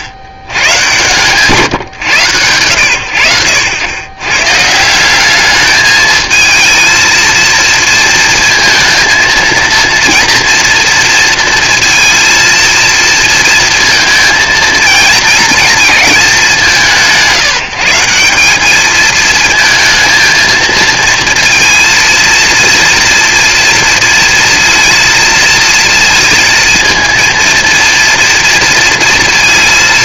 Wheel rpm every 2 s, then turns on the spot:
140, 70, 150, 230, 230, 230, 230, 230, 190, 210, 230, 230, 230, 230, 230.
none